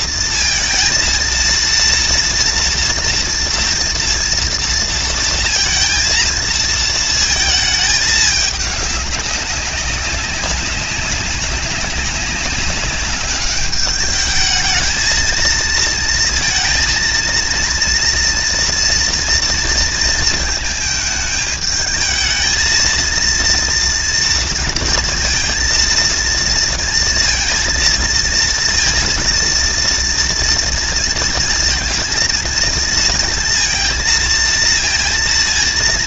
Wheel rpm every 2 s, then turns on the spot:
230, 240, 240, 230, 200, 200, 200, 220, 230, 240, 220, 220, 230, 230, 230, 230, 230, 230.
none